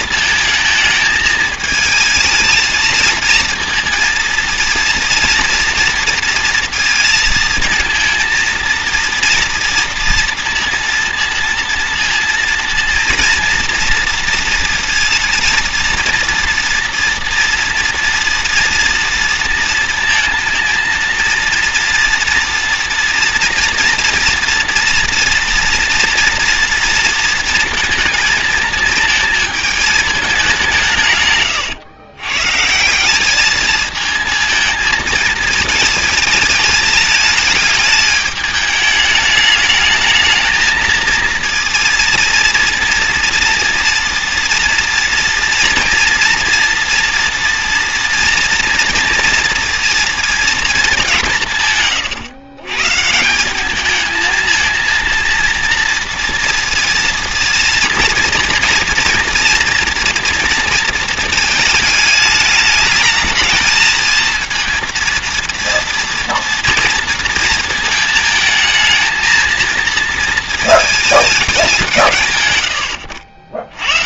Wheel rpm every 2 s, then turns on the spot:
220, 220, 230, 230, 230, 230, 230, 230, 230, 230, 230, 230, 230, 230, 230, 180, 150, 220, 220, 210, 230, 230, 240, 230, 230, 220, 130, 230, 230, 230, 230, 210, 230, 230, 220, 220, 110.
none